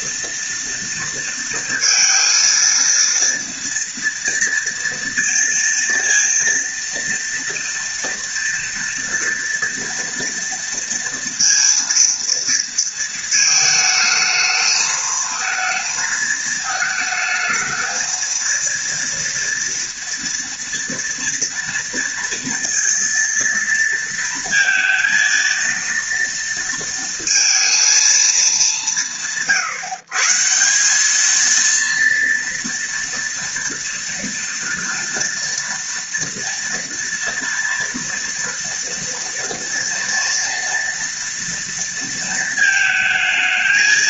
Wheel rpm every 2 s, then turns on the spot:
230, 230, 230, 230, 230, 230, 230, 220, 220, 230, 230, 230, 230, 230, 170, 180, 230, 230, 230, 240, 230, 230.
none